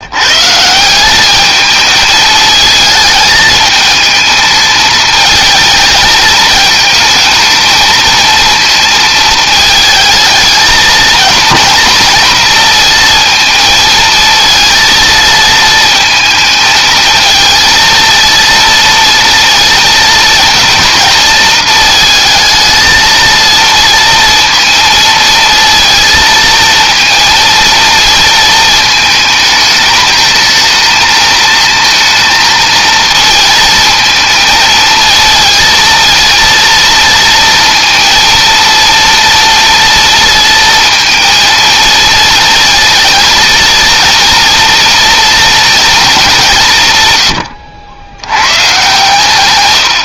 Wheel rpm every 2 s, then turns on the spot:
180, 220, 220, 220, 220, 220, 230, 230, 220, 230, 230, 230, 230, 230, 220, 220, 220, 230, 230, 230, 230, 230, 230, 130, 130.
none